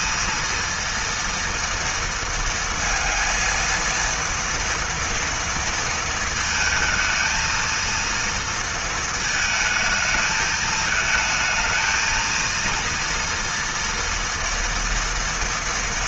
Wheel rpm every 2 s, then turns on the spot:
230, 230, 230, 220, 220, 220, 230, 230.
none